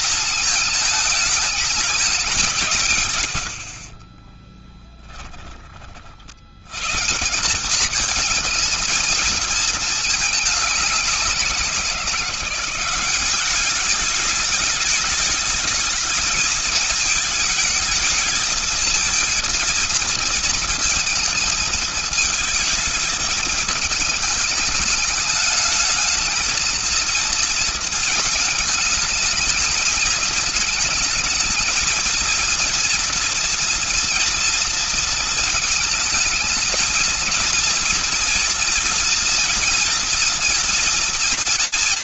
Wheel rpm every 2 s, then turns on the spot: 220, 180, 20, 80, 230, 210, 180, 210, 220, 220, 230, 220, 210, 220, 220, 220, 230, 230, 220, 240, 240.
4-6